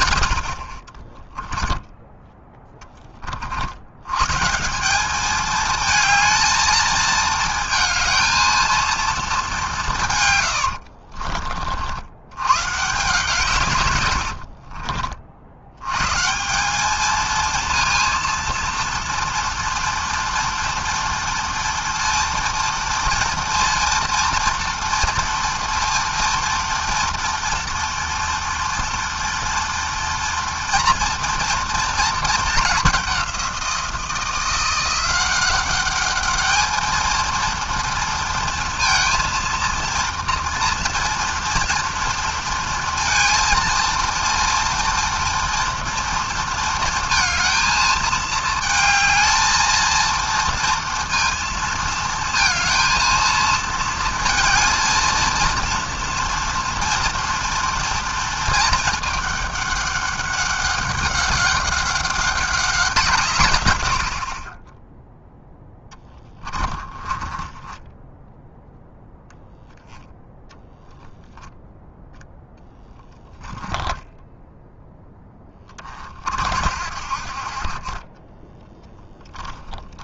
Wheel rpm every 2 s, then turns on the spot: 20, 50, 210, 220, 210, 40, 150, 60, 220, 240, 230, 230, 230, 230, 240, 230, 190, 180, 230, 230, 230, 230, 230, 220, 220, 230, 230, 230, 230, 210, 200, 140, 0, 30, 0, 0, 10, 10, 50, 10.
0-2 66-68 72-74